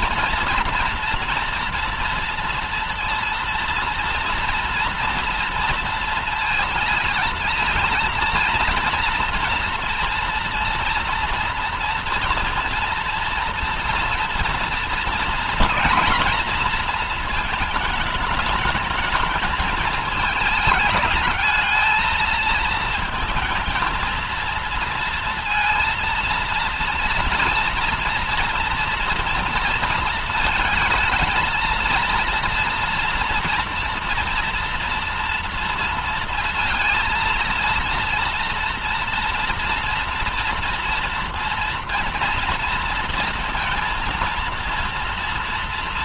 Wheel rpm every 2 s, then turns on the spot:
240, 240, 230, 230, 230, 240, 230, 230, 230, 210, 210, 220, 230, 230, 240, 220, 230, 240, 230, 230, 230, 230, 230.
none